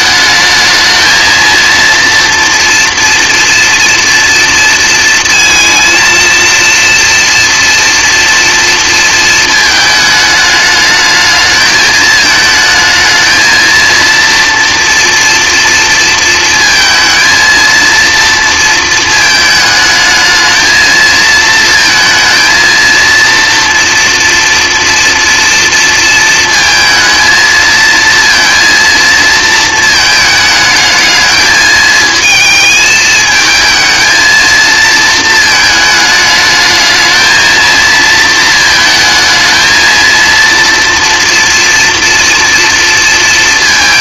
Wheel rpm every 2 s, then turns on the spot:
220, 240, 230, 230, 230, 210, 220, 230, 230, 220, 230, 230, 230, 220, 230, 210, 220, 220, 220, 220, 230, 230.
none